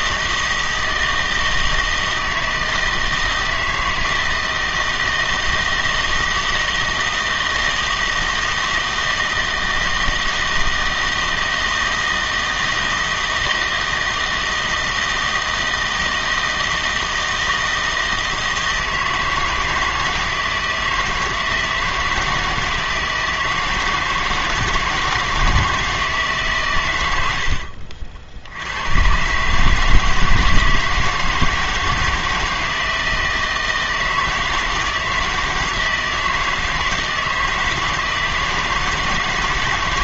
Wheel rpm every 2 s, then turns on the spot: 160, 160, 160, 160, 160, 160, 160, 160, 160, 160, 160, 160, 160, 130, 90, 160, 160, 160, 160, 160.
none